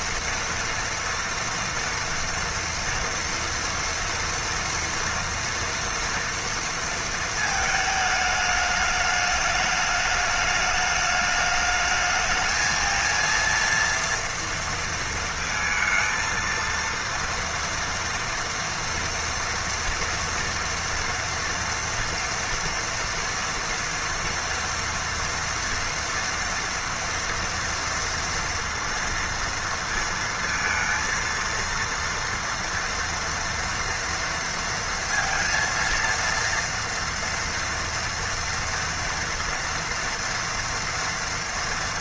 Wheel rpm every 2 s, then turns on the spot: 230, 240, 230, 230, 210, 210, 220, 230, 230, 240, 230, 230, 230, 230, 230, 230, 230, 230, 230, 230, 230.
none